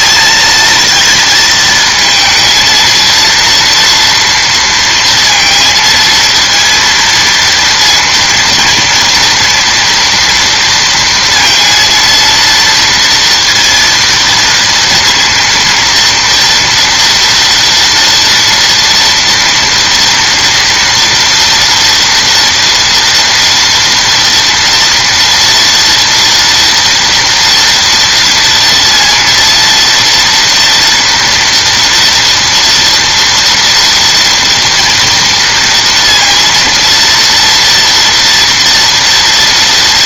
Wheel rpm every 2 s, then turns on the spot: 230, 230, 230, 230, 230, 230, 230, 230, 240, 230, 230, 230, 230, 230, 230, 230, 230, 240, 230, 230.
none